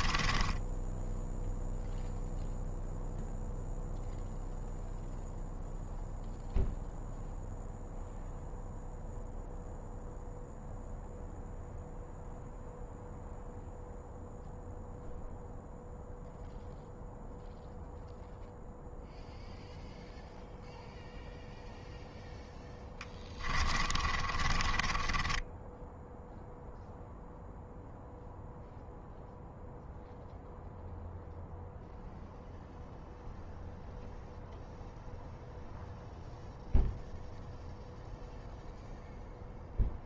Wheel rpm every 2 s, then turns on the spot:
10, 0, 0, 0, 0, 0, 0, 0, 0, 0, 0, 10, 20, 0, 0, 0, 0, 0, 0, 0.
0-2 22-26